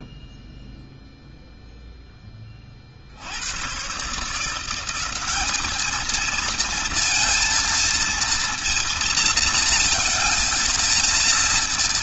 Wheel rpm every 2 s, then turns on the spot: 0, 30, 180, 230, 230, 230.
none